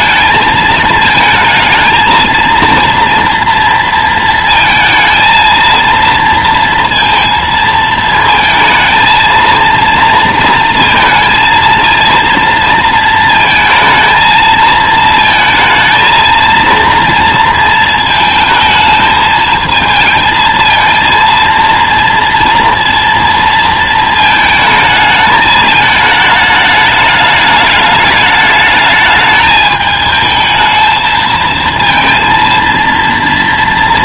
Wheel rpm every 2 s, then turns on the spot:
220, 230, 230, 230, 220, 230, 230, 220, 230, 220, 230, 230, 220, 210, 210, 220, 230.
none